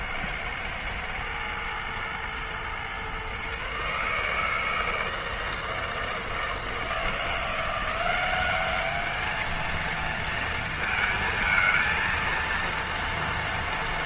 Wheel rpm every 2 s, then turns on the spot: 110, 120, 160, 160, 200, 230, 230.
none